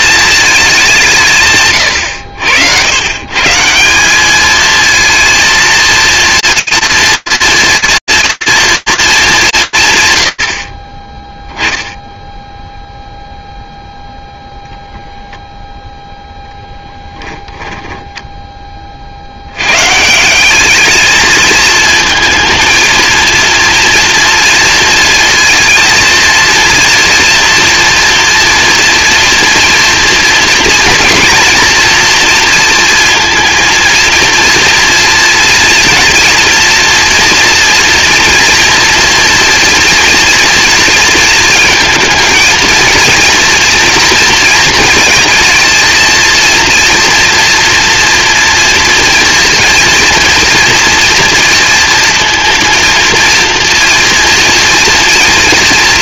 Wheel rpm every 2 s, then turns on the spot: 190, 110, 220, 240, 230, 80, 0, 0, 10, 60, 220, 230, 230, 230, 240, 240, 230, 230, 230, 240, 230, 240, 230, 240, 230, 230, 230, 230.
16-18